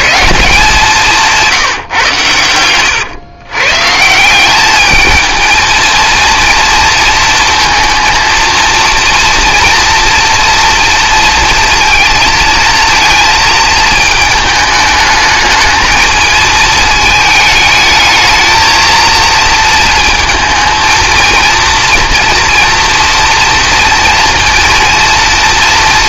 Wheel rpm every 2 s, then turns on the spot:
190, 110, 200, 230, 230, 230, 230, 220, 220, 230, 230, 240, 230.
2-4